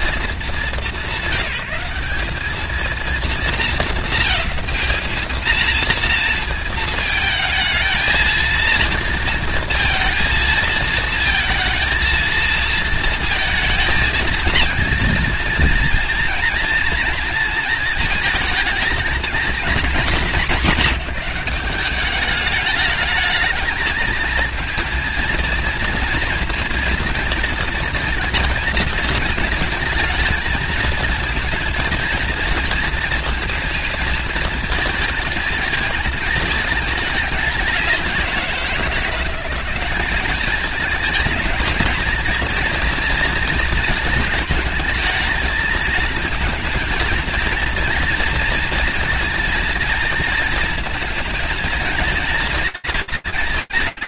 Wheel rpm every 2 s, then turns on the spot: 200, 210, 220, 220, 230, 230, 230, 230, 230, 220, 190, 210, 220, 230, 230, 230, 230, 230, 220, 180, 210, 230, 220, 230, 230, 230, 230.
none